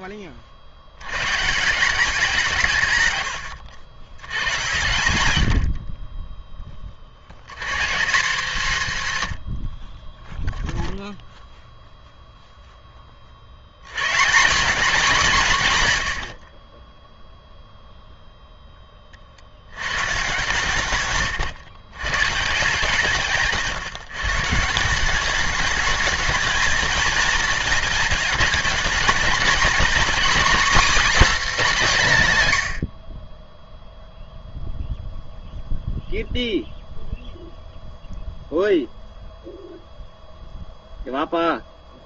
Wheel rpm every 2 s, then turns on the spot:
80, 160, 90, 10, 200, 0, 0, 200, 30, 10, 140, 150, 150, 230, 210, 270, 140, 0, 0, 0, 0.
none